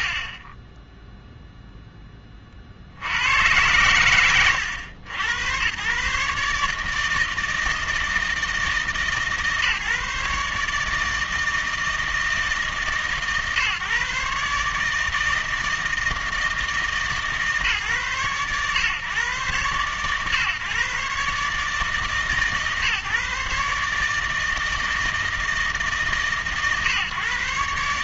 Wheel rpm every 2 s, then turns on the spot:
10, 40, 100, 150, 160, 150, 150, 150, 160, 130, 130, 150, 160, 130.
none